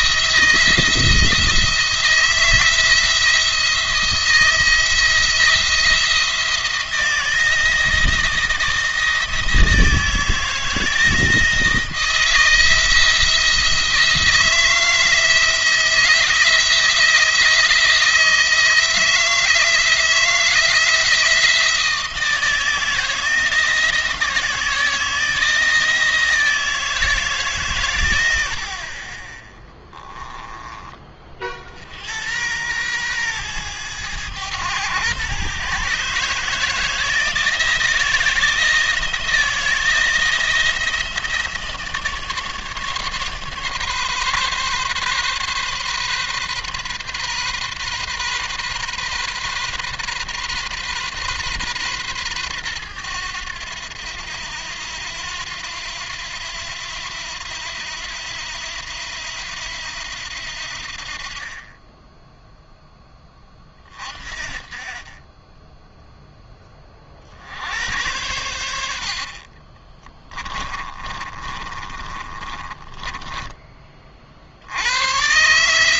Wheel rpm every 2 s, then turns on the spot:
160, 170, 160, 170, 170, 160, 160, 160, 170, 160, 170, 160, 160, 160, 80, 10, 110, 110, 160, 160, 160, 150, 140, 130, 130, 130, 110, 90, 90, 80, 70, 10, 30, 20, 90, 20, 40, 70.
70-74